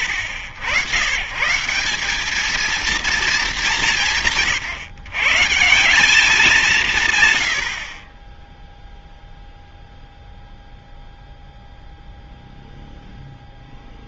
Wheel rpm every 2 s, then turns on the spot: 100, 220, 160, 210, 0, 0, 0.
none